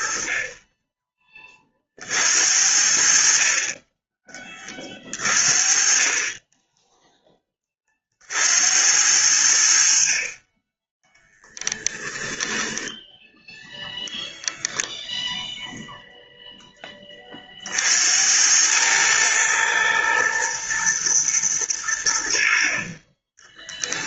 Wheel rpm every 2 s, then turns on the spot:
20, 60, 30, 10, 70, 20, 10, 0, 10, 110, 110, 40.
none